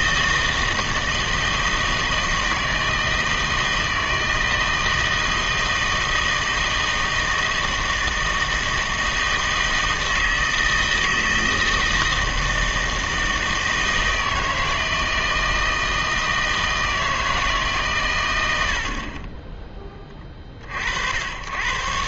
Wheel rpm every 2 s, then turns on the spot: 160, 160, 160, 160, 160, 160, 160, 160, 160, 80, 40.
none